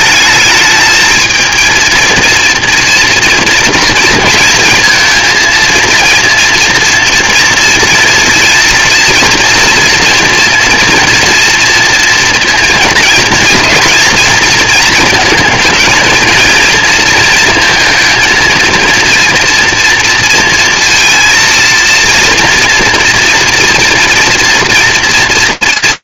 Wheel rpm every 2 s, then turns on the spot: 220, 230, 220, 230, 230, 240, 230, 230, 230, 230, 230, 230, 230.
none